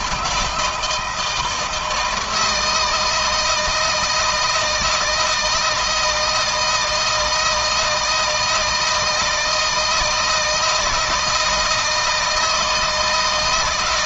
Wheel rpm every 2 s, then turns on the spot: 160, 160, 160, 160, 160, 160, 150.
none